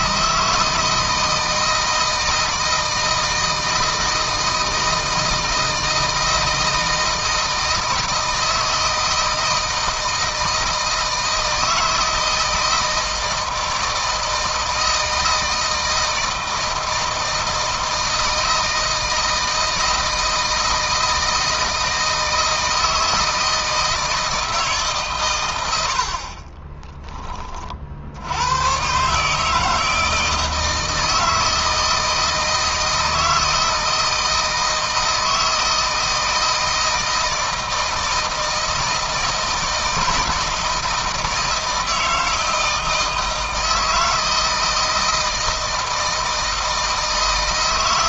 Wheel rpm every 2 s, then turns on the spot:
160, 160, 160, 160, 160, 160, 160, 160, 160, 160, 160, 160, 140, 30, 130, 160, 160, 160, 160, 160, 160, 160, 160, 160.
none